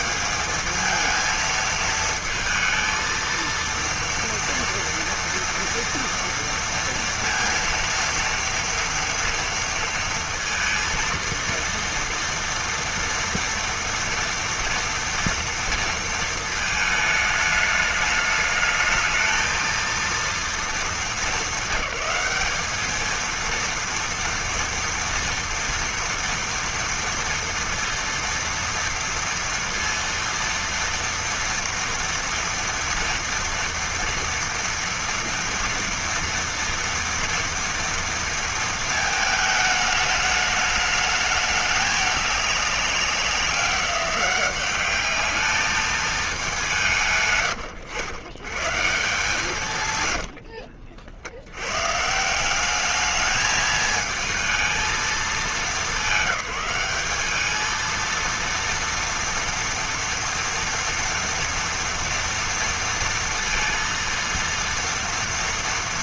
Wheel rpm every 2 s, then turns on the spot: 190, 220, 230, 230, 230, 230, 230, 230, 220, 210, 230, 210, 230, 230, 230, 230, 230, 230, 230, 230, 210, 210, 190, 210, 120, 90, 160, 220, 190, 230, 230, 230, 230.
50-52